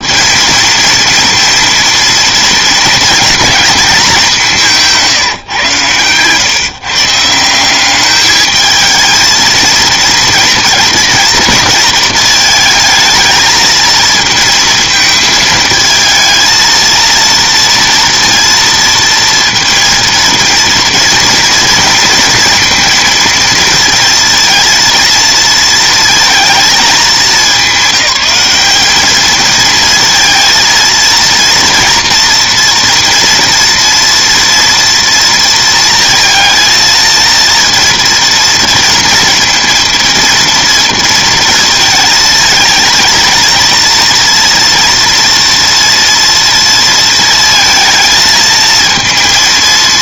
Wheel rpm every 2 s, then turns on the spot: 220, 230, 170, 140, 220, 230, 220, 220, 230, 230, 230, 230, 230, 220, 200, 230, 230, 230, 230, 230, 230, 220, 230, 230, 230.
none